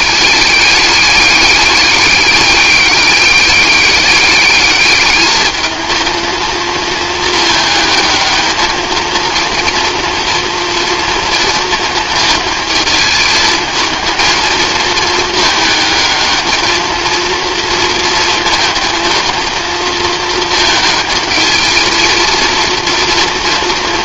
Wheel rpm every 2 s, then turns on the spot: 210, 200, 210, 230, 220, 230, 220, 220, 220, 230, 220, 230.
none